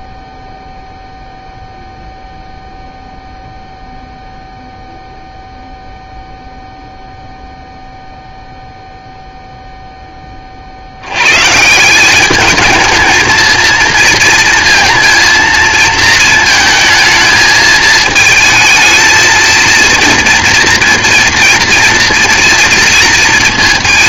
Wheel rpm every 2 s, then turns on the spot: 0, 0, 0, 0, 0, 50, 210, 230, 220, 220, 240, 230.
none